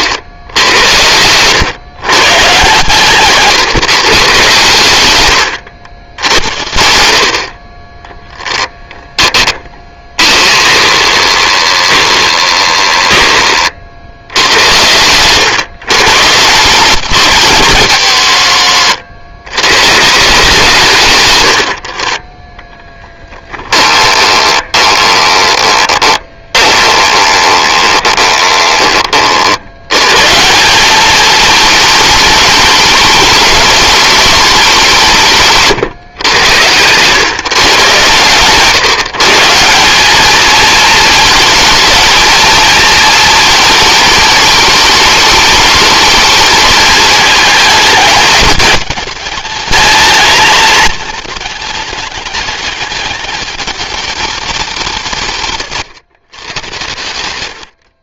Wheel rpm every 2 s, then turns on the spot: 100, 130, 130, 80, 10, 30, 20, 100, 170, 80, 160, 10, 20, 20, 30, 190, 210, 200, 110, 150, 220, 220, 210, 210, 220, 220, 210, 190, 120.
10-14 18-20 24-30